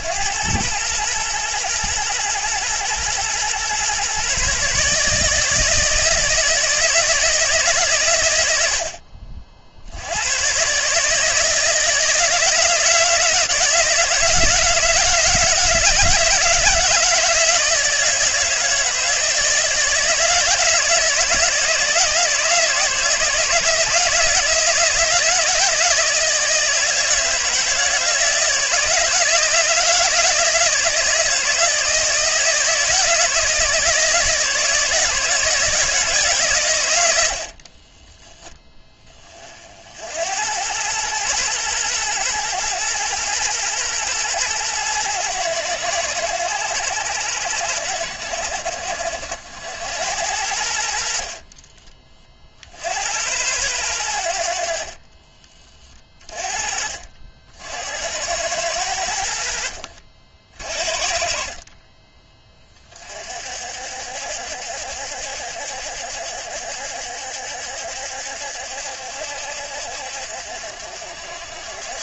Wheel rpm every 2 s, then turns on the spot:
110, 120, 150, 160, 60, 150, 160, 160, 160, 160, 160, 160, 160, 160, 160, 160, 160, 160, 90, 20, 110, 110, 110, 100, 70, 50, 70, 40, 50, 80, 50, 40, 70, 70, 70, 60.
50-52 54-56